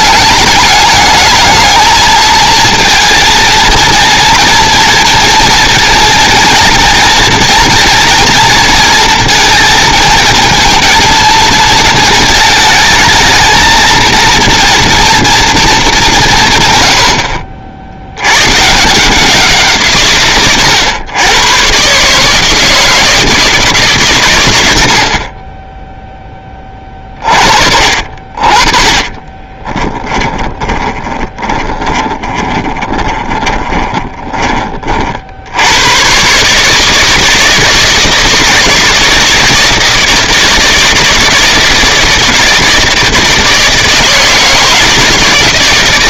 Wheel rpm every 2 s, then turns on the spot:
210, 220, 230, 240, 240, 230, 210, 230, 100, 150, 120, 160, 70, 30, 40, 30, 20, 40, 160, 160, 160, 160, 160.
28-34